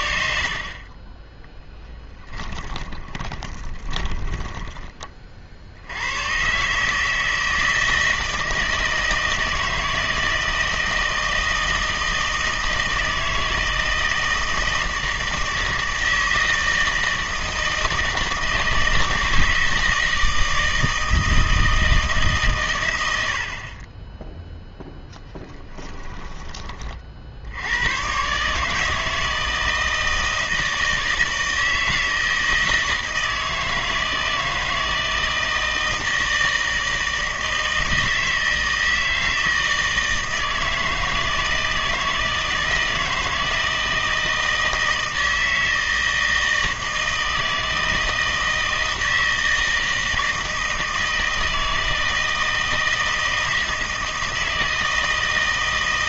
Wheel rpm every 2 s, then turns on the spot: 40, 20, 10, 140, 160, 160, 160, 160, 160, 160, 160, 120, 10, 30, 150, 160, 160, 160, 160, 160, 160, 160, 160, 160, 160, 160, 160, 160.
2-4